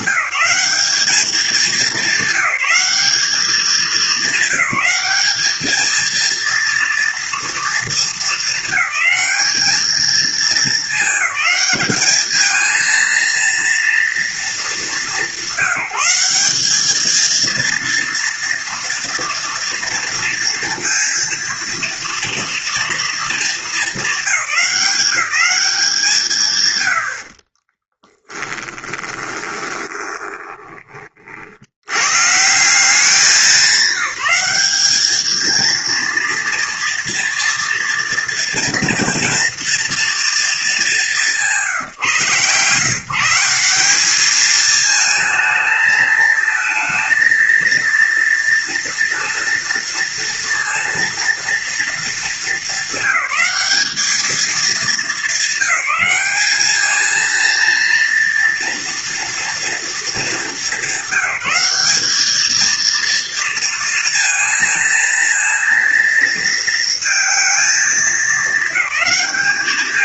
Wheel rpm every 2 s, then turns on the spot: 200, 200, 210, 230, 220, 220, 220, 210, 200, 230, 230, 230, 180, 120, 10, 20, 170, 200, 230, 230, 200, 130, 220, 220, 230, 230, 200, 210, 210, 230, 200, 220, 230, 230, 220.
28-30